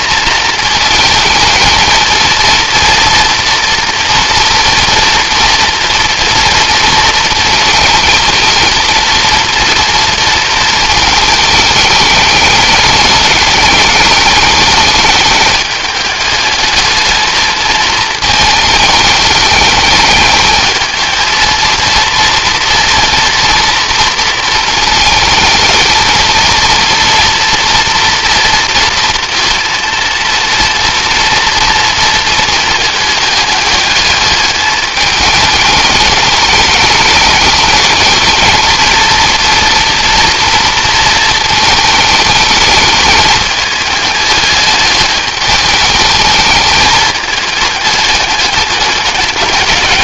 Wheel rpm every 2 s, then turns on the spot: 220, 230, 230, 230, 230, 220, 210, 210, 220, 220, 220, 230, 230, 230, 230, 230, 220, 210, 210, 220, 230, 220, 210, 210, 200.
none